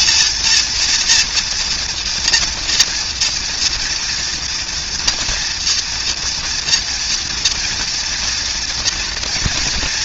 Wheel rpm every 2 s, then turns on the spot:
230, 240, 230, 240, 230.
none